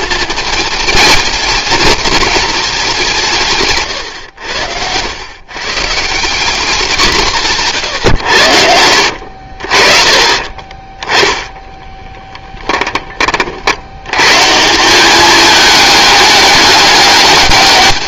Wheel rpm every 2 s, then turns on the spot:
220, 200, 90, 190, 60, 20, 10, 180, 200.
8-10